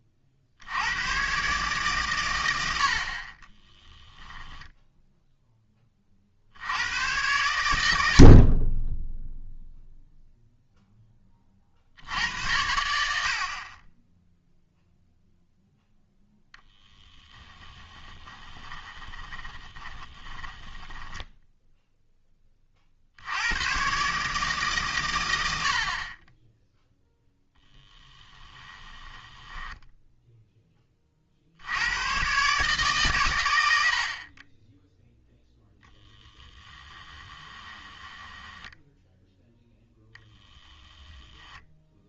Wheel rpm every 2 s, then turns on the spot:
80, 80, 0, 80, 20, 0, 80, 0, 10, 20, 20, 40, 140, 0, 10, 20, 140, 10, 10, 10, 10.
16-22 28-30 38-42